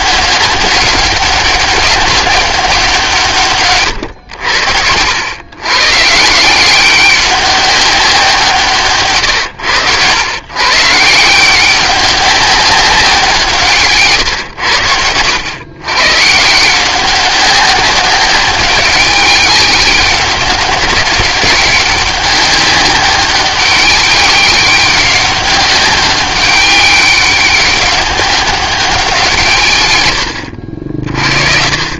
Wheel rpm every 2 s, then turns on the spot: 200, 180, 80, 180, 140, 140, 200, 90, 170, 190, 190, 200, 200, 200, 190, 60.
none